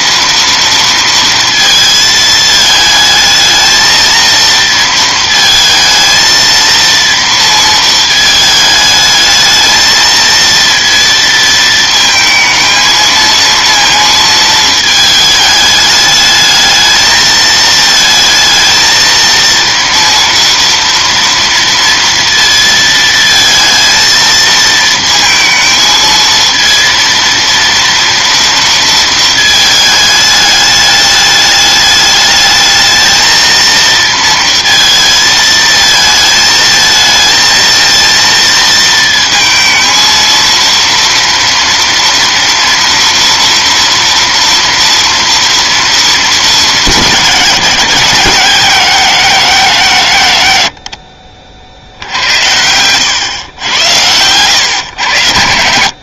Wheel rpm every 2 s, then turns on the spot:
230, 220, 230, 230, 220, 230, 220, 220, 220, 220, 230, 220, 230, 230, 230, 210, 220, 230, 220, 230, 230, 230, 230, 200, 190, 90, 80, 110.
none